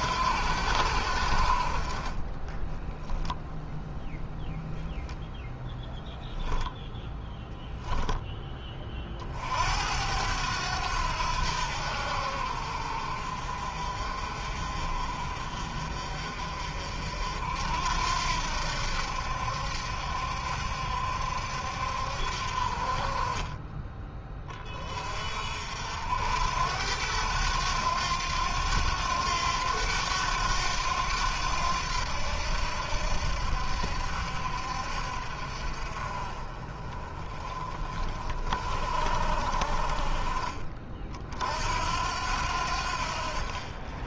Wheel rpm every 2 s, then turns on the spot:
80, 10, 0, 0, 20, 90, 60, 50, 60, 70, 70, 50, 40, 80, 90, 90, 80, 60, 30, 40, 40, 70.
2-4